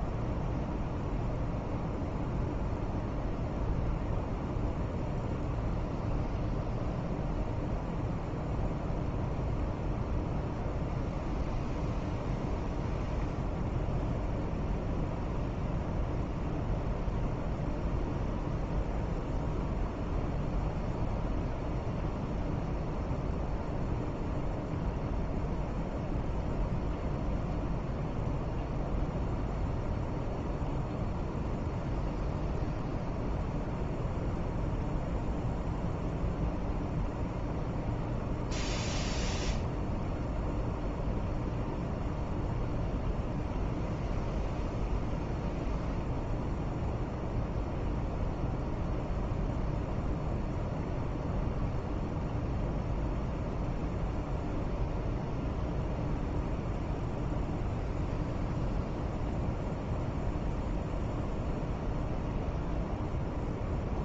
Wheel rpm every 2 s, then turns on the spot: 0, 0, 0, 0, 0, 0, 0, 0, 0, 0, 0, 0, 0, 0, 0, 0, 0, 0, 0, 0, 0, 0, 0, 0, 0, 0, 0, 0, 0, 0, 0, 0.
none